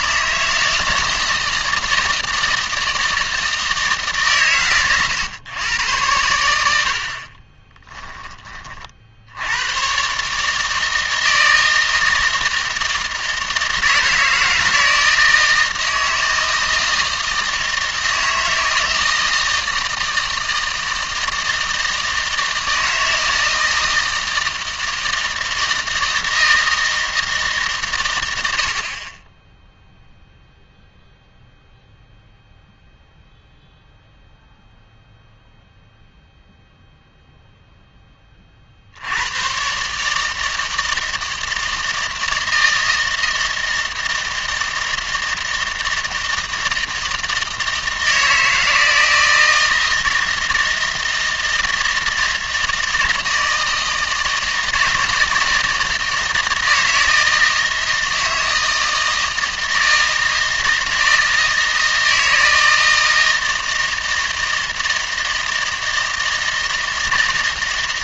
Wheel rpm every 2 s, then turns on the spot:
160, 160, 130, 80, 30, 150, 160, 160, 160, 160, 160, 160, 160, 160, 60, 0, 0, 0, 0, 60, 160, 160, 160, 160, 160, 160, 160, 160, 160, 160, 160, 160, 160, 160.
none